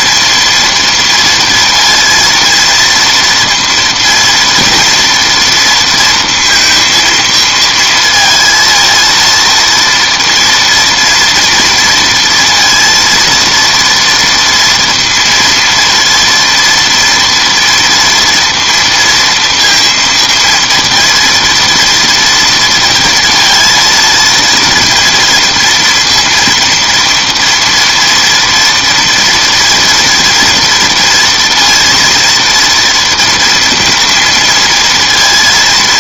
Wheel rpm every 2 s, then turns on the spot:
230, 230, 230, 230, 230, 230, 230, 230, 230, 230, 230, 230, 230, 230, 230, 230, 230, 230.
none